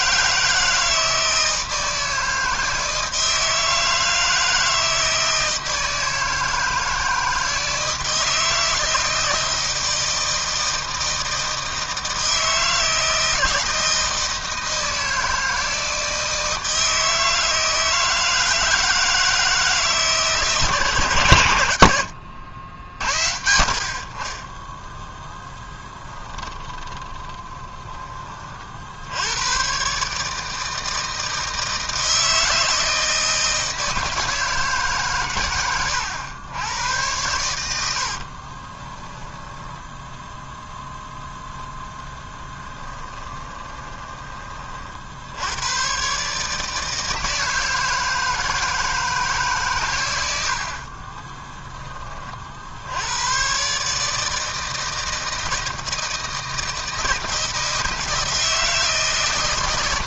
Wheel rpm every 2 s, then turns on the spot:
160, 160, 160, 160, 160, 160, 160, 160, 160, 160, 120, 80, 10, 20, 80, 160, 160, 140, 100, 10, 0, 10, 50, 160, 160, 40, 80, 160, 160, 160.
26-28 38-40 42-44 50-52